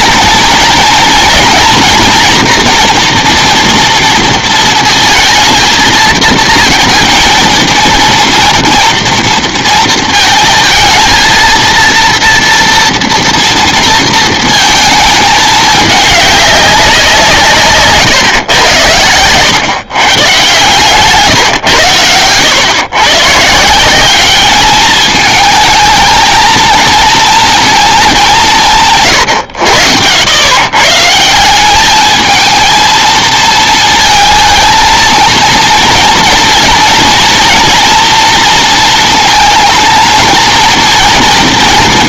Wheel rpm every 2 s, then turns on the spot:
230, 240, 230, 230, 230, 220, 230, 230, 200, 110, 150, 110, 210, 230, 170, 110, 220, 220, 230, 230, 230.
none